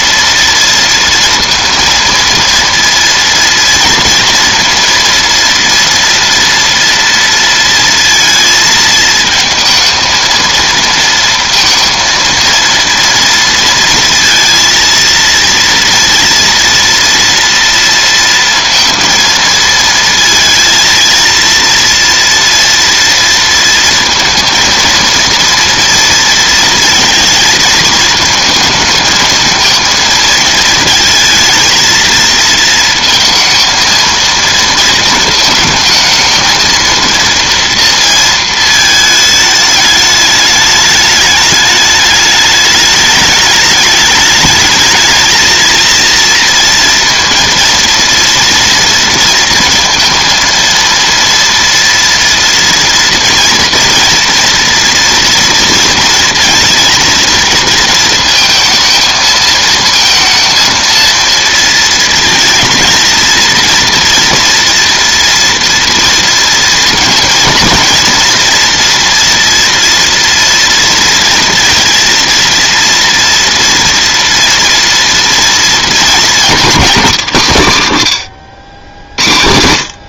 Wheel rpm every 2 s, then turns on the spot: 230, 230, 230, 230, 230, 230, 230, 230, 230, 220, 230, 240, 230, 230, 220, 220, 220, 220, 230, 230, 210, 210, 210, 230, 230, 230, 230, 230, 230, 230, 230, 230, 230, 230, 230, 230, 230, 230, 230, 90.
none